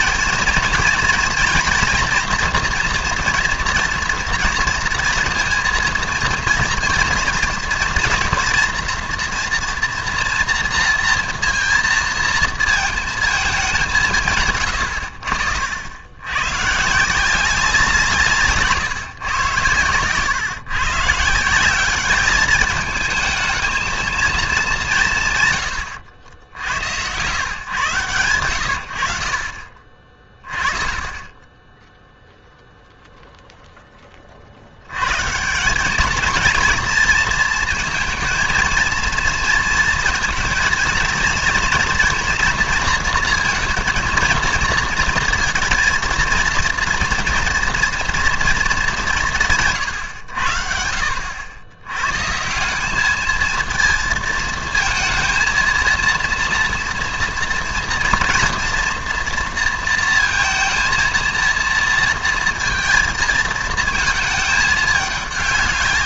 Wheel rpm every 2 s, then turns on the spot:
220, 240, 230, 230, 230, 230, 230, 120, 120, 150, 130, 210, 210, 80, 90, 20, 0, 70, 230, 230, 230, 230, 230, 230, 220, 70, 170, 220, 230, 230, 230, 230, 220.
none